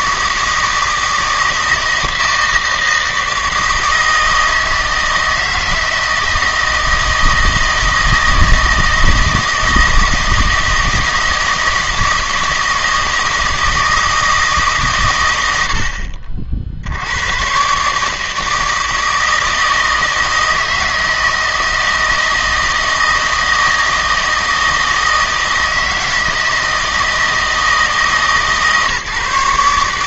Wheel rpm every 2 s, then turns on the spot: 160, 160, 160, 160, 160, 160, 160, 140, 60, 160, 160, 160, 160, 160, 150.
none